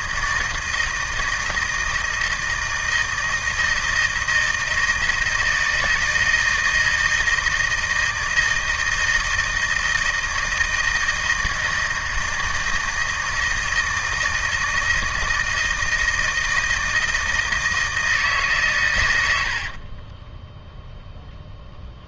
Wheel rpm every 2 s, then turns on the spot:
160, 160, 160, 160, 160, 160, 160, 160, 160, 130, 0.
none